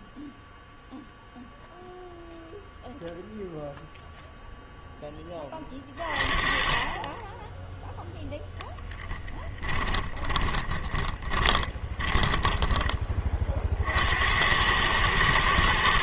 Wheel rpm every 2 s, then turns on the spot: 0, 0, 0, 30, 0, 20, 20, 90.
10-14